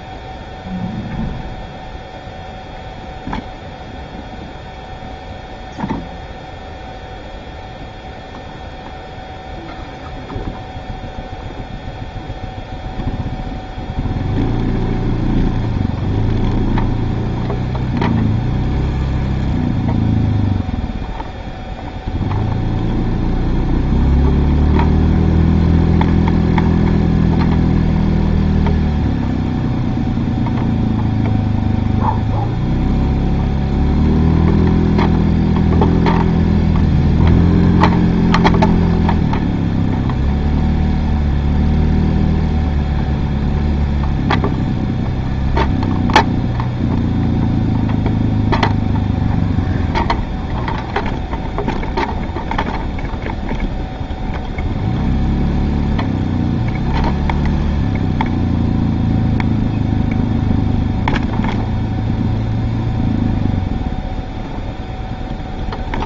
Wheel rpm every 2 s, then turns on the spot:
0, 0, 0, 0, 0, 0, 0, 0, 0, 0, 0, 0, 0, 0, 0, 0, 0, 0, 0, 0, 0, 0, 0, 0, 0, 0, 0, 0, 0, 0, 0, 0, 0.
none